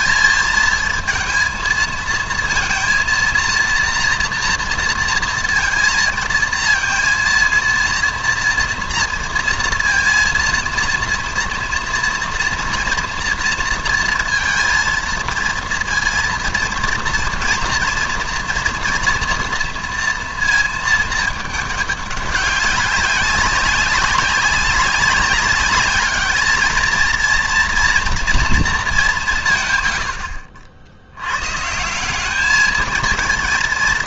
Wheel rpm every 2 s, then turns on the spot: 220, 230, 230, 230, 230, 230, 230, 230, 230, 240, 220, 190, 190, 220, 220, 60, 220.
none